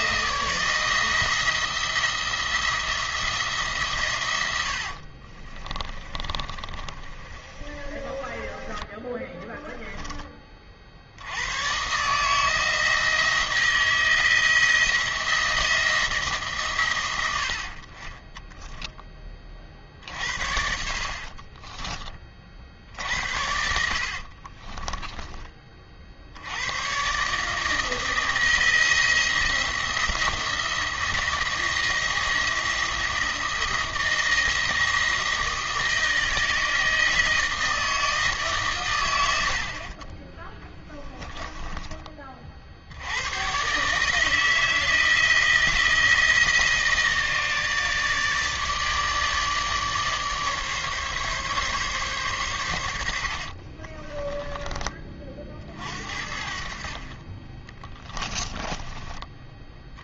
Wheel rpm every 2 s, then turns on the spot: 160, 170, 60, 40, 20, 50, 160, 170, 130, 10, 70, 50, 20, 110, 170, 170, 160, 160, 160, 120, 10, 60, 160, 160, 150, 150, 100, 20, 50, 20.
4-10 20-22 24-26 58-60